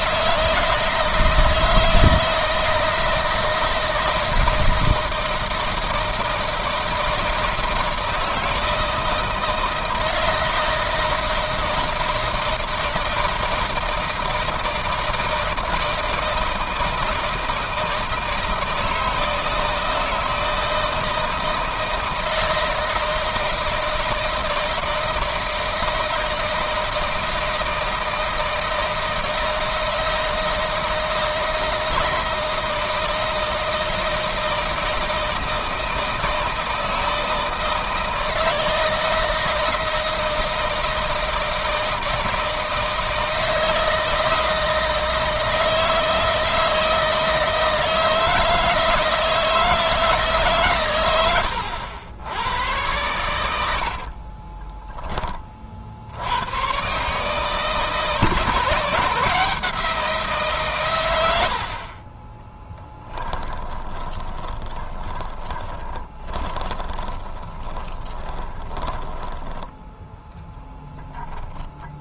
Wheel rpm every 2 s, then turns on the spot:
160, 160, 160, 160, 160, 160, 160, 160, 160, 160, 160, 160, 160, 160, 160, 160, 160, 160, 160, 160, 160, 160, 160, 160, 160, 130, 100, 20, 120, 160, 130, 10, 20, 20, 10, 20.
62-72